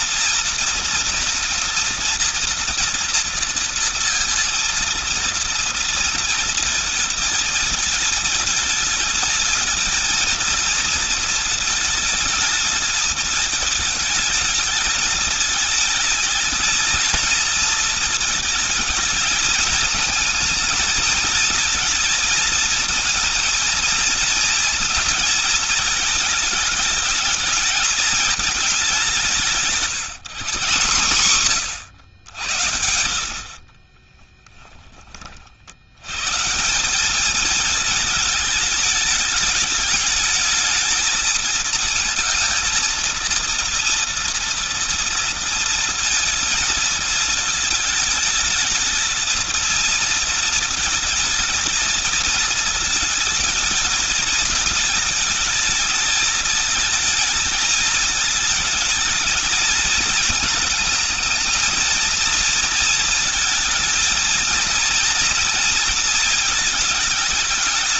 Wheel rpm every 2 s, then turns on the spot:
230, 230, 230, 220, 220, 230, 220, 220, 220, 220, 220, 230, 230, 220, 210, 170, 100, 20, 160, 210, 210, 230, 230, 220, 220, 230, 220, 220, 220, 220, 220, 230, 230, 220.
none